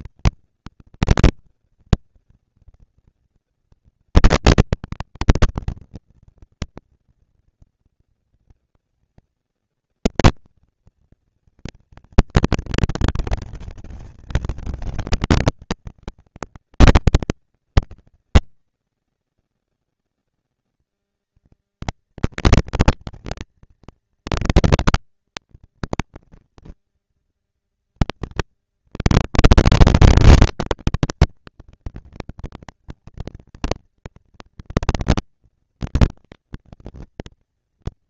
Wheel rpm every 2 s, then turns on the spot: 230, 230, 230, 230, 230, 230, 230, 210, 200, 200, 220, 220, 230, 230, 230, 230, 230, 230, 230.
none